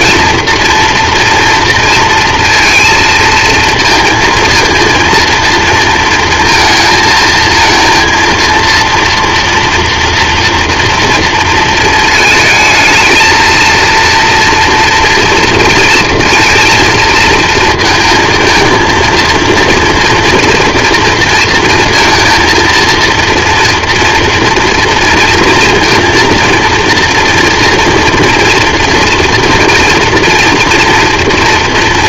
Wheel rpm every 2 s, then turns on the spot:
230, 230, 230, 230, 230, 230, 220, 230, 230, 220, 230, 230, 230, 230, 230, 230.
none